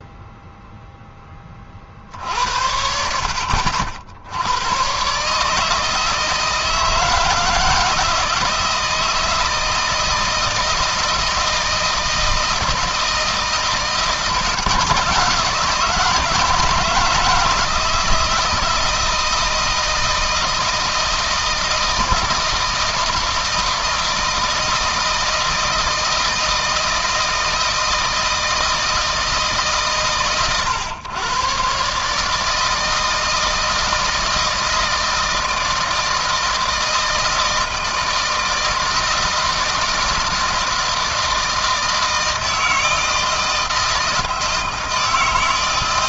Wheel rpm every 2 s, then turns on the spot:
10, 70, 120, 160, 160, 160, 160, 160, 160, 160, 160, 160, 160, 160, 160, 120, 160, 160, 160, 160, 160, 160, 160.
none